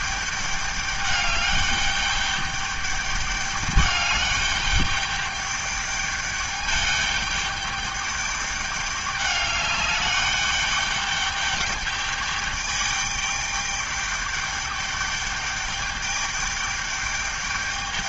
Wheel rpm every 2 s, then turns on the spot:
210, 210, 210, 210, 210, 210, 210, 210, 210.
none